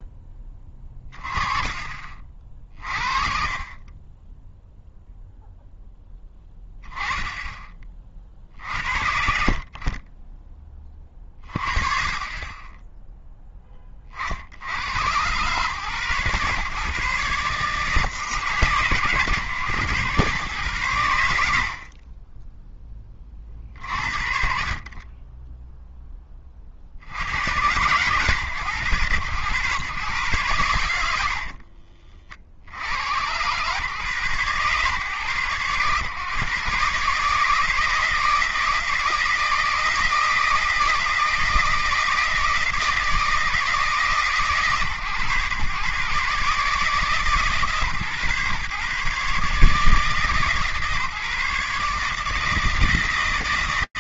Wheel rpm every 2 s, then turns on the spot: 20, 50, 10, 10, 50, 20, 20, 60, 130, 120, 120, 10, 40, 30, 110, 120, 60, 120, 130, 160, 160, 160, 140, 140, 140, 150, 160.
8-10 22-24